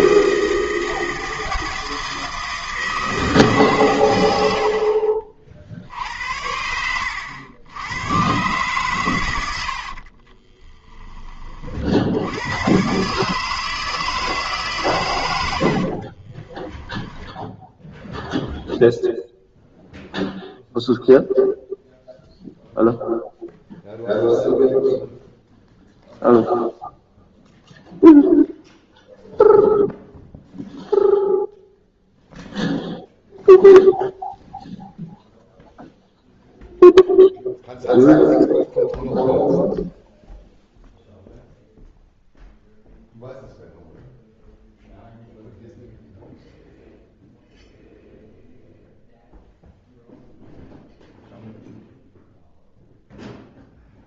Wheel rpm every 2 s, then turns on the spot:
160, 160, 70, 90, 130, 20, 120, 140, 20, 0, 0, 0, 0, 0, 0, 0, 0, 0, 0, 0, 0, 0, 0, 0, 0, 0, 0.
4-8 10-12 16-18